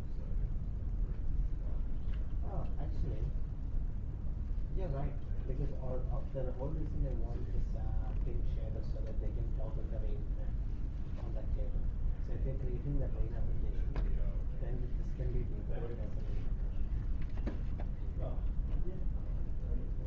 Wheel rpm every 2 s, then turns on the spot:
0, 0, 0, 0, 0, 0, 0, 0, 0, 0.
none